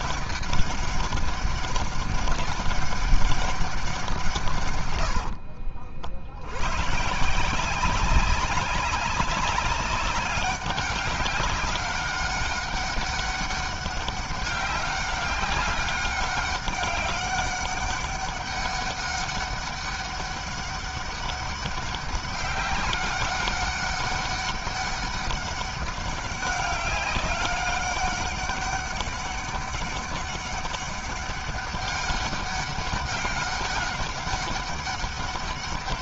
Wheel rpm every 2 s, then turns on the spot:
200, 200, 150, 70, 190, 200, 200, 200, 200, 200, 200, 200, 200, 200, 200, 200, 200, 190.
none